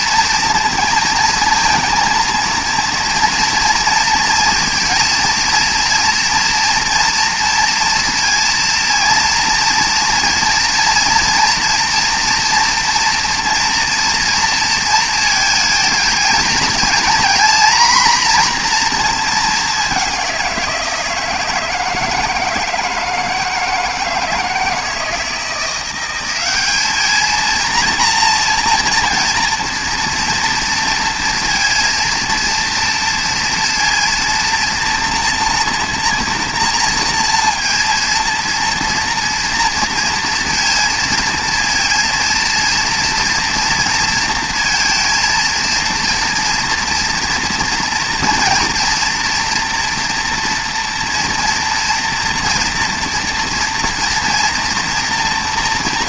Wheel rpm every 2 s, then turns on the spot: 230, 230, 230, 240, 230, 230, 240, 230, 230, 230, 170, 160, 160, 210, 230, 230, 230, 240, 230, 230, 230, 230, 230, 240, 240, 230, 230, 230.
none